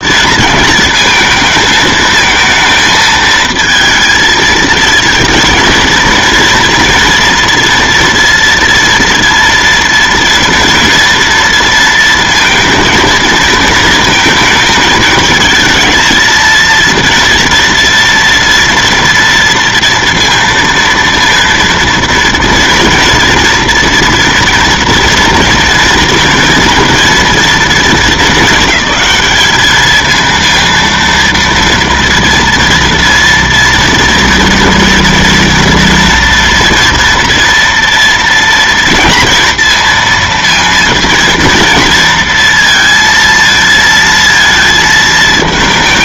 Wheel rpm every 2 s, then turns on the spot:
230, 220, 230, 230, 230, 230, 230, 220, 230, 230, 230, 230, 230, 230, 200, 230, 230, 230, 230, 230, 230, 230, 230.
none